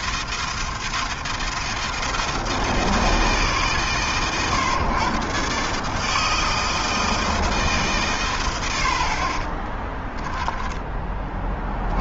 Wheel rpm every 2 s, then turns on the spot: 160, 140, 130, 150, 20, 40.
8-10